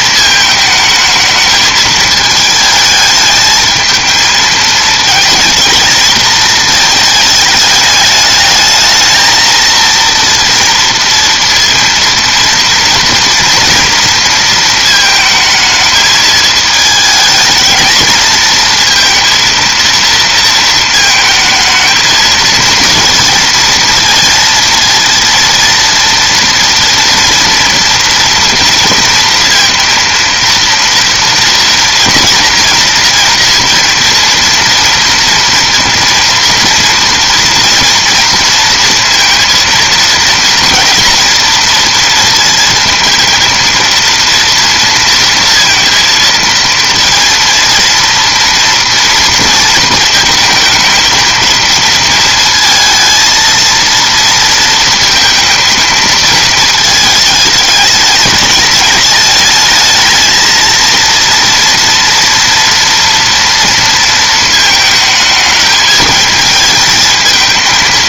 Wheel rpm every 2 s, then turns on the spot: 220, 220, 220, 220, 220, 230, 230, 220, 220, 230, 230, 230, 230, 240, 230, 230, 230, 230, 230, 230, 230, 230, 230, 230, 230, 220, 230, 230, 220, 220, 230, 230, 220, 220.
none